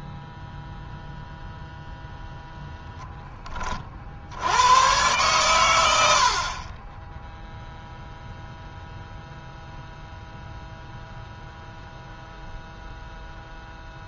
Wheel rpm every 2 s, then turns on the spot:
0, 0, 80, 50, 0, 0, 0.
none